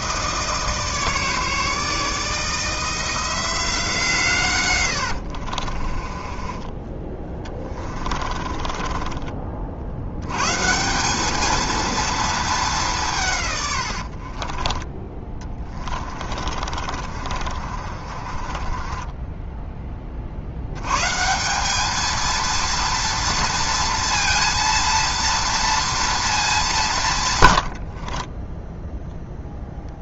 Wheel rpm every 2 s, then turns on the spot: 150, 160, 90, 20, 30, 170, 200, 20, 50, 20, 100, 230, 230, 160, 0.
4-6 8-10 14-20